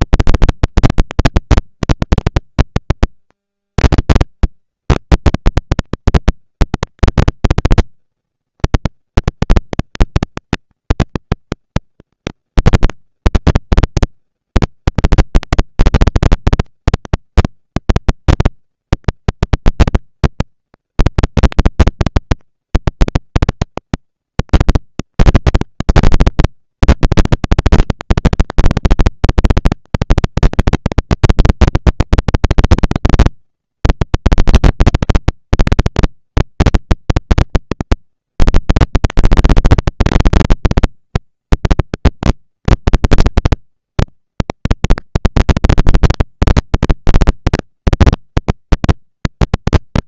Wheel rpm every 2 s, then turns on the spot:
230, 230, 230, 230, 230, 230, 210, 200, 220, 230, 240, 230, 230, 240, 230, 230, 230, 240, 230, 230, 230, 230, 240, 210, 200.
none